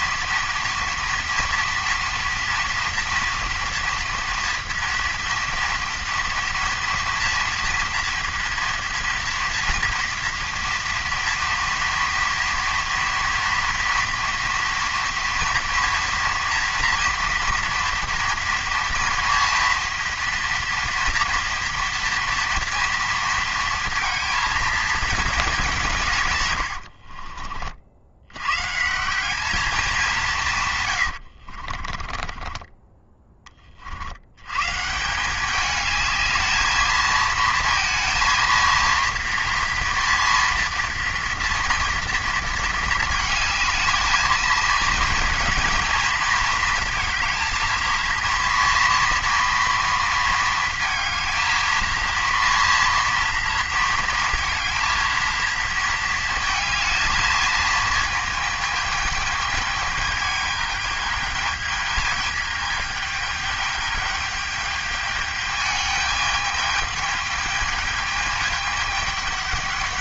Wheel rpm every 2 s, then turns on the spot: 230, 230, 230, 230, 230, 230, 230, 240, 230, 240, 240, 230, 220, 70, 150, 130, 20, 150, 220, 230, 230, 220, 220, 230, 240, 230, 230, 220, 220, 220, 210, 210, 210, 210, 210.
26-28 32-34